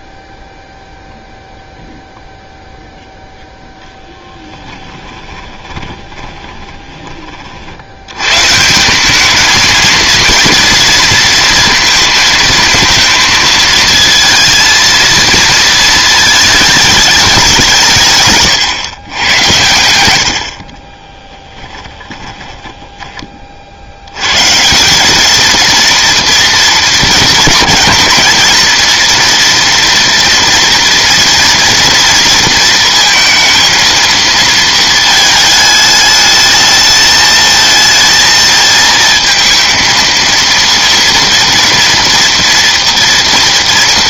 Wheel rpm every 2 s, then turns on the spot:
0, 0, 10, 20, 160, 230, 220, 230, 210, 130, 60, 10, 160, 230, 230, 240, 230, 230, 220, 220, 230, 230.
4-8 22-24